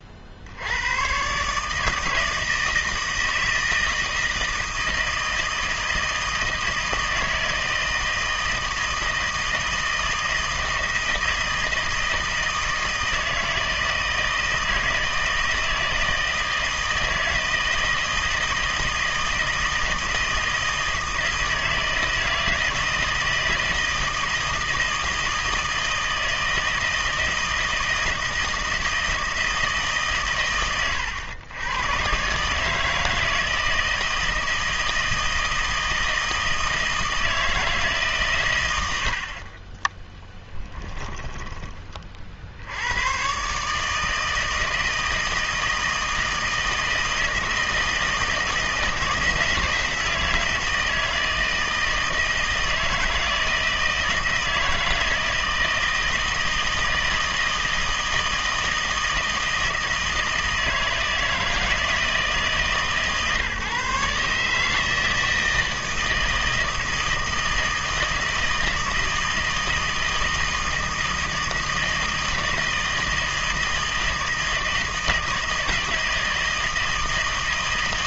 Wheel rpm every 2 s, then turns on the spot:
90, 160, 160, 160, 160, 160, 160, 160, 160, 160, 160, 160, 160, 160, 160, 120, 150, 160, 160, 100, 20, 80, 160, 160, 160, 160, 160, 160, 160, 160, 160, 150, 160, 160, 160, 160, 160, 160, 160.
40-42